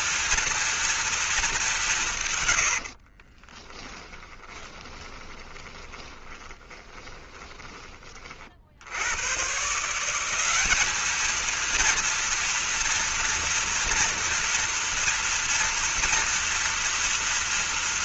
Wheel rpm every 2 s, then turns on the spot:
230, 80, 20, 20, 80, 210, 230, 230, 230.
2-8